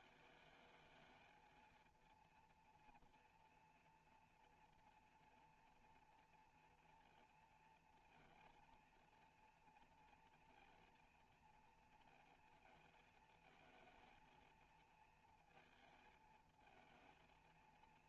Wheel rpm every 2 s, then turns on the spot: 220, 230, 230, 230, 230, 230, 220, 230, 220.
none